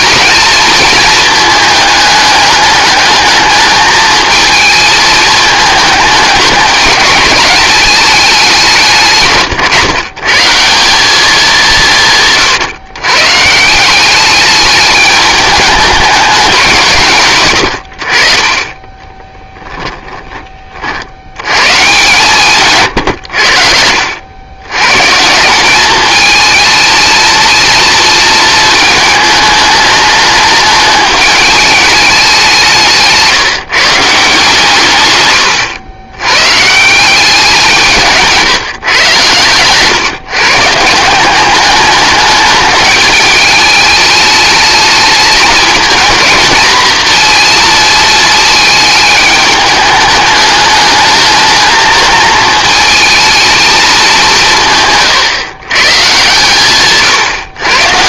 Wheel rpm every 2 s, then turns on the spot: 220, 210, 220, 220, 180, 180, 130, 210, 170, 20, 40, 130, 120, 220, 230, 210, 170, 140, 160, 130, 160, 210, 210, 220, 220, 210, 220, 160, 140.
none